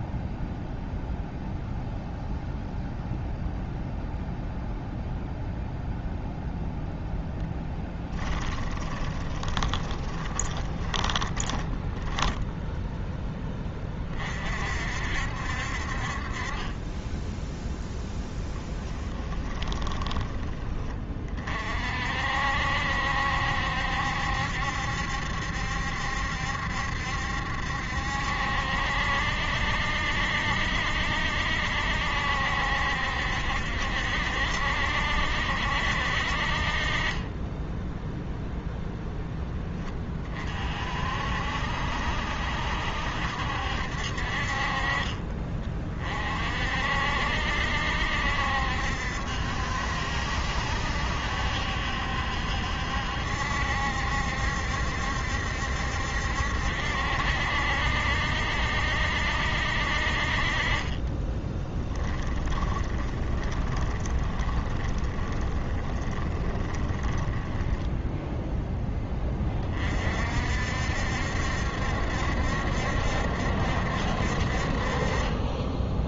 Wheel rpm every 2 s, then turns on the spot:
0, 0, 0, 0, 20, 10, 0, 60, 20, 10, 20, 60, 70, 70, 70, 60, 70, 70, 30, 0, 50, 70, 30, 60, 70, 70, 70, 70, 70, 70, 30, 20, 20, 20, 10, 70, 70, 30.
8-12 18-20 60-68